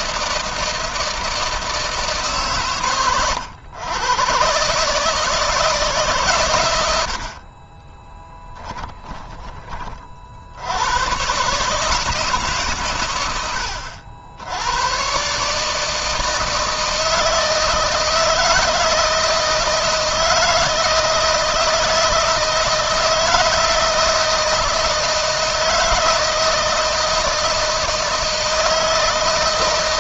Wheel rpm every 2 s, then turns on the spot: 160, 130, 150, 90, 10, 100, 120, 120, 160, 160, 160, 160, 160, 160, 160.
8-10